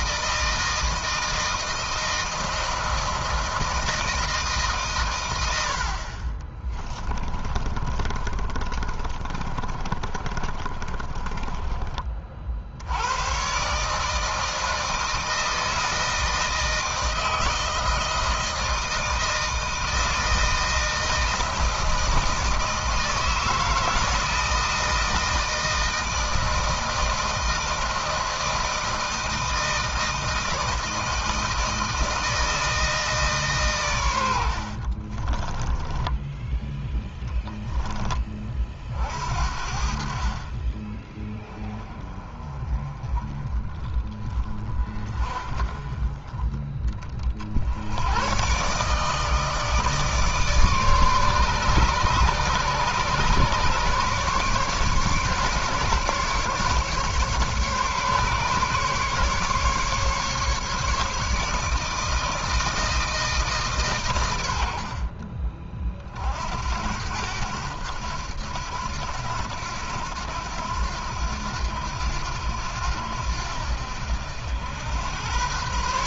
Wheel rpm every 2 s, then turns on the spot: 160, 160, 130, 30, 30, 30, 80, 160, 160, 160, 160, 160, 160, 160, 160, 160, 160, 50, 10, 40, 20, 30, 30, 30, 140, 150, 140, 140, 140, 140, 150, 160, 50, 80, 90, 90, 80, 100.
6-12 34-38 64-66